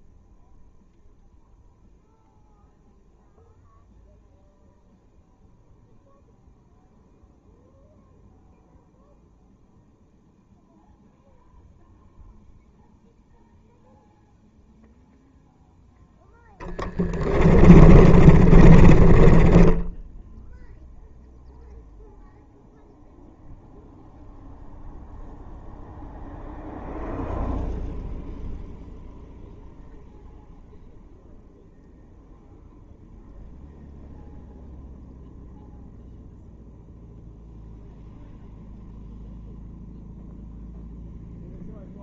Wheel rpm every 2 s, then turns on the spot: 0, 0, 0, 0, 0, 0, 0, 0, 10, 30, 0, 0, 0, 0, 0, 0, 0, 0, 0, 0, 0.
16-20